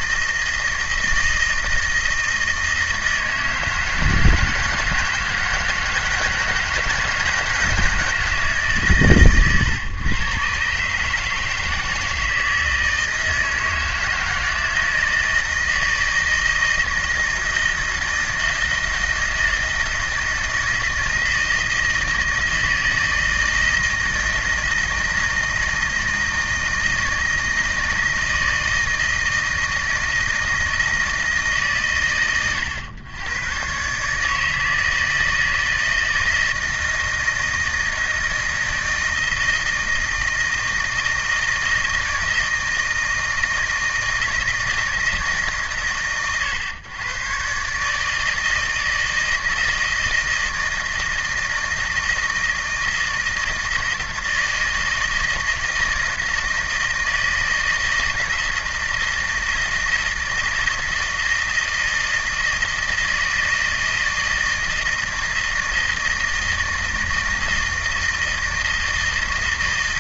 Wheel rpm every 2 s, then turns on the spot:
160, 160, 160, 160, 140, 130, 160, 160, 160, 160, 160, 160, 160, 160, 160, 160, 90, 160, 160, 160, 160, 160, 160, 110, 160, 160, 160, 160, 160, 170, 160, 160, 160, 160, 160.
none